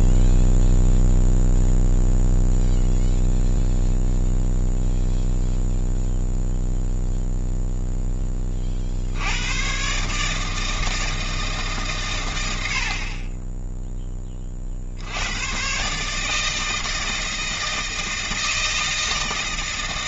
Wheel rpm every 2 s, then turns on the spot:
0, 0, 0, 0, 30, 160, 70, 50, 160, 160.
none